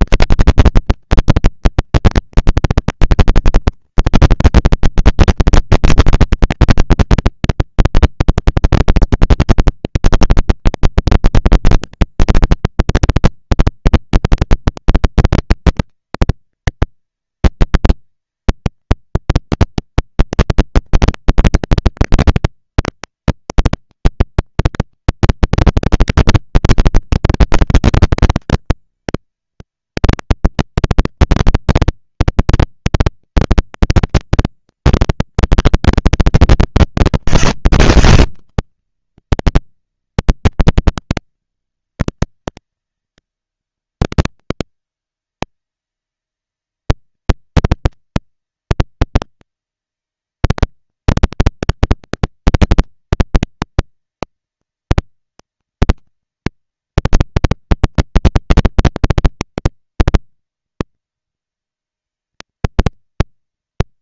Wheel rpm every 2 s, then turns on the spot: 210, 210, 220, 220, 210, 220, 240, 230, 230, 230, 220, 220, 230, 220, 210, 230, 230, 230, 220, 200, 190, 190, 200, 220, 230, 230, 220, 230, 230, 230, 230, 230.
none